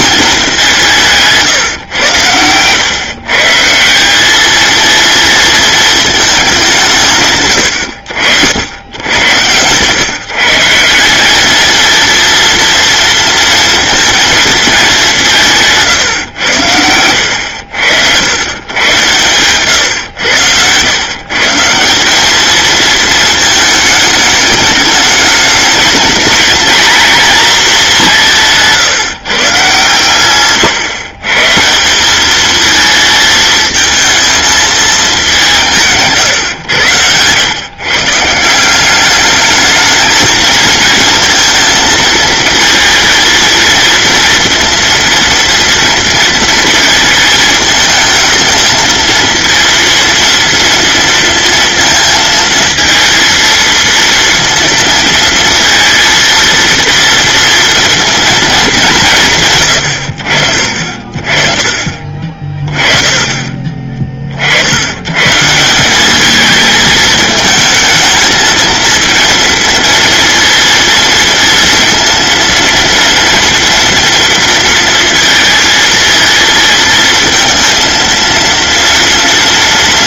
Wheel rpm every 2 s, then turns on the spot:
170, 130, 230, 150, 90, 180, 230, 180, 80, 120, 120, 230, 210, 230, 140, 130, 220, 210, 100, 210, 230, 220, 230, 220, 230, 230, 230, 230, 230, 160, 40, 30, 120, 220, 230, 230, 230, 230, 230, 230.
none